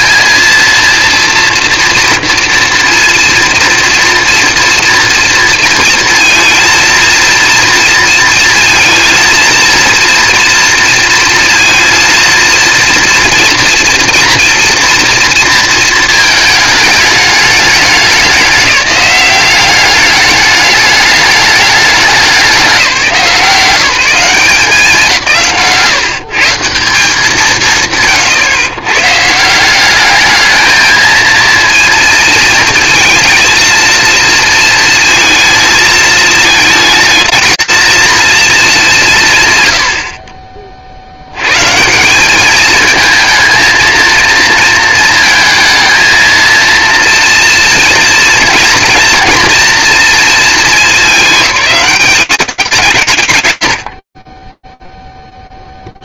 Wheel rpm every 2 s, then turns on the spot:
230, 230, 230, 230, 230, 230, 230, 230, 220, 190, 210, 190, 180, 160, 120, 220, 230, 230, 220, 220, 40, 210, 230, 230, 230, 220, 200, 30.
none